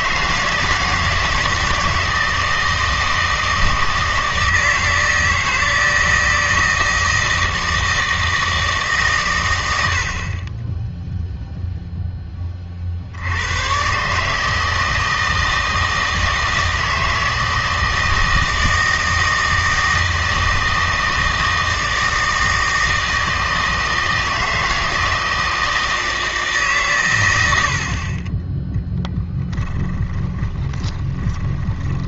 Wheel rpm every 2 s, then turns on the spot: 160, 160, 160, 160, 160, 20, 40, 160, 160, 160, 160, 160, 160, 140, 10, 20.
30-32